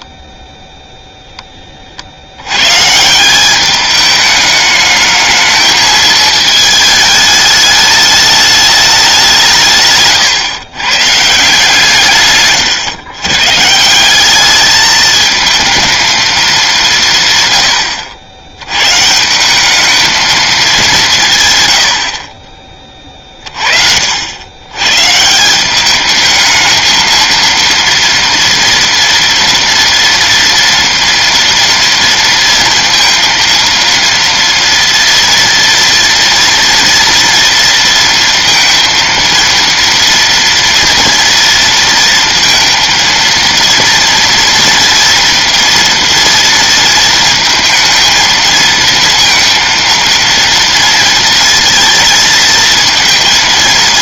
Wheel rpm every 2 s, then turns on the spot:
10, 90, 210, 220, 210, 140, 140, 200, 210, 100, 220, 40, 110, 220, 230, 240, 230, 230, 230, 230, 230, 230, 230, 230, 230, 230, 230.
none